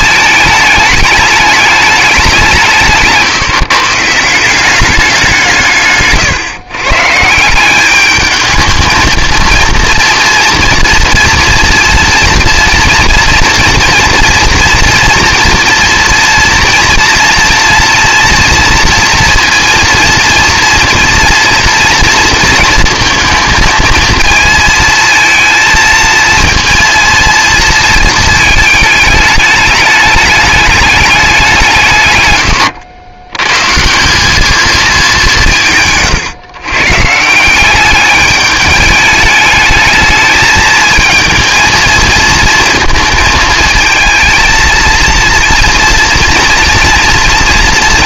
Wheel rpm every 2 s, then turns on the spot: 210, 180, 190, 130, 220, 230, 230, 230, 240, 230, 230, 230, 220, 230, 220, 210, 90, 210, 130, 210, 220, 230, 220, 230.
32-34